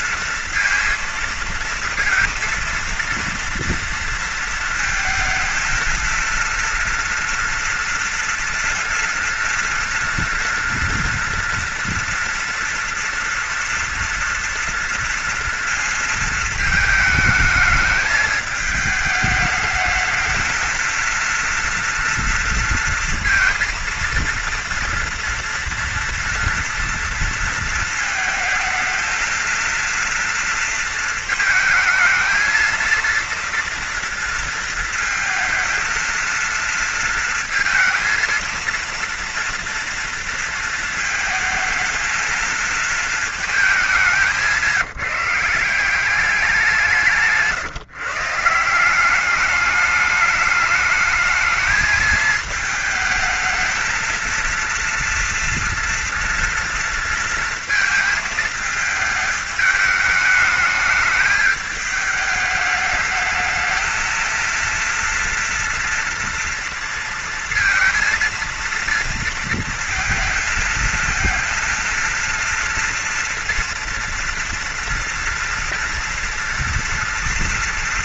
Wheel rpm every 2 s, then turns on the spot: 230, 230, 220, 230, 230, 230, 230, 230, 220, 210, 220, 230, 230, 230, 220, 230, 230, 230, 230, 230, 230, 220, 180, 190, 160, 210, 220, 230, 230, 220, 210, 210, 230, 230, 230, 230, 230, 230, 230.
none